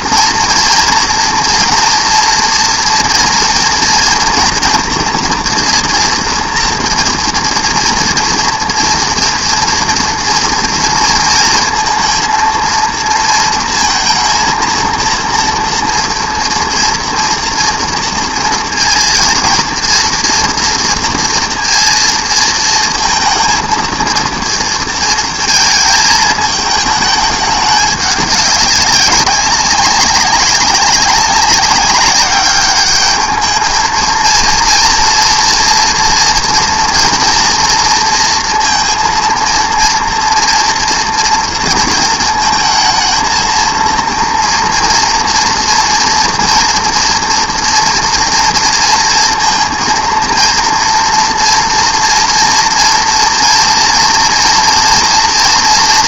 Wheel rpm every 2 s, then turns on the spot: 230, 230, 230, 240, 230, 230, 230, 230, 230, 230, 230, 230, 230, 220, 200, 200, 210, 230, 230, 230, 230, 220, 230, 230, 230, 230, 230, 230.
none